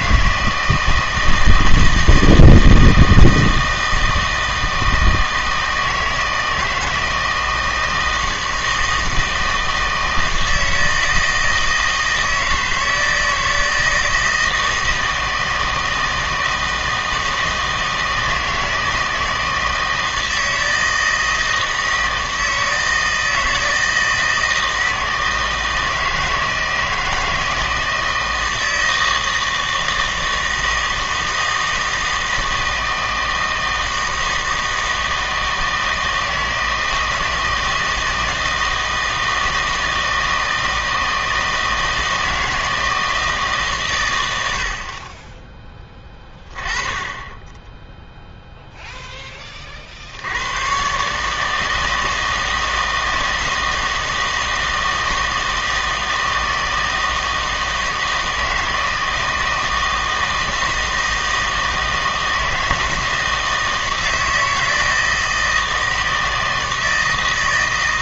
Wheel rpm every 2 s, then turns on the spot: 160, 160, 160, 160, 160, 160, 160, 160, 160, 160, 160, 160, 160, 160, 160, 160, 160, 160, 160, 160, 160, 160, 70, 20, 0, 110, 160, 160, 160, 160, 160, 160, 160, 160.
none